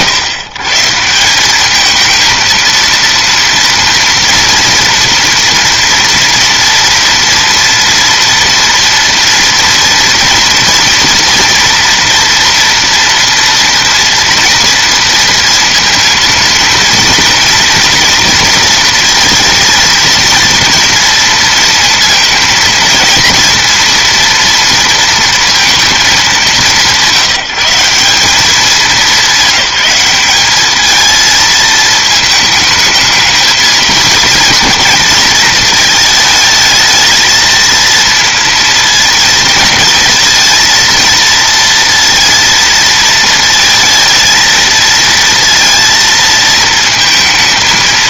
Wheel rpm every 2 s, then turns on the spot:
130, 230, 230, 230, 230, 230, 230, 230, 230, 230, 230, 230, 230, 180, 200, 210, 220, 220, 220, 230, 230, 230, 220, 220.
none